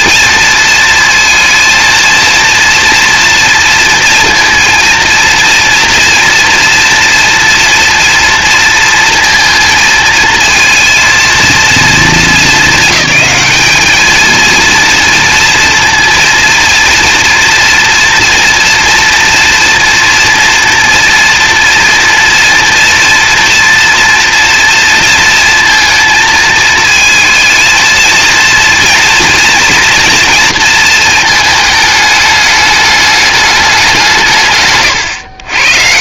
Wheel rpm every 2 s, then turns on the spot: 230, 230, 230, 230, 230, 220, 200, 230, 230, 230, 230, 230, 230, 230, 230, 220, 210, 120.
34-36